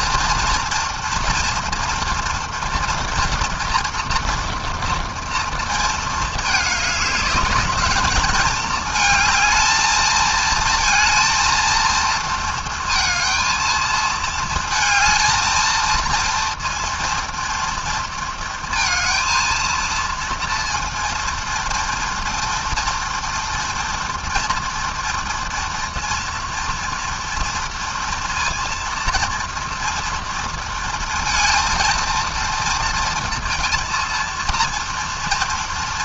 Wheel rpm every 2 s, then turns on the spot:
240, 230, 230, 210, 220, 230, 230, 230, 230, 230, 230, 240, 240, 230, 230, 230, 230, 230.
none